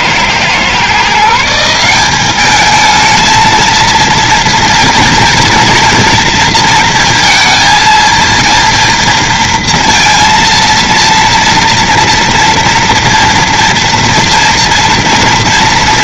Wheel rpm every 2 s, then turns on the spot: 130, 210, 230, 230, 230, 230, 230, 230.
none